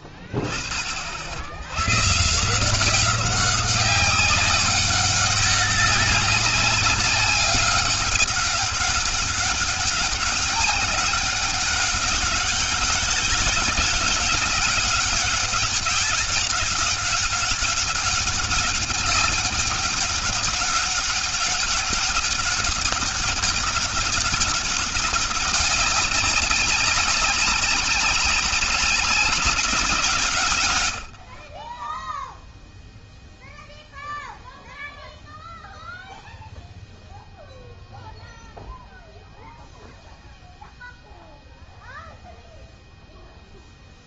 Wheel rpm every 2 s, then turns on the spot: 60, 190, 200, 190, 200, 200, 200, 200, 200, 200, 200, 190, 200, 200, 190, 30, 0, 0, 0, 0, 0, 0.
none